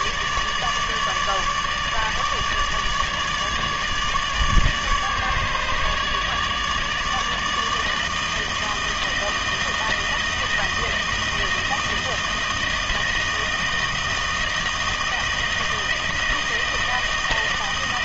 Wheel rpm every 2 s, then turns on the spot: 150, 150, 150, 150, 160, 160, 160, 160, 160.
none